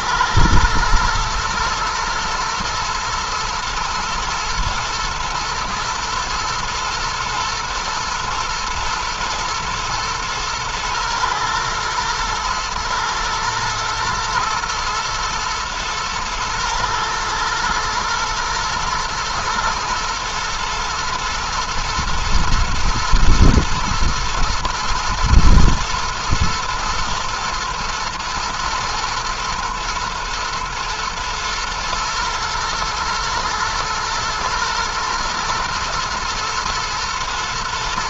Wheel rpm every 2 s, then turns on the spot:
110, 120, 120, 110, 110, 120, 110, 120, 120, 110, 110, 110, 120, 120, 110, 110, 120, 110, 120.
none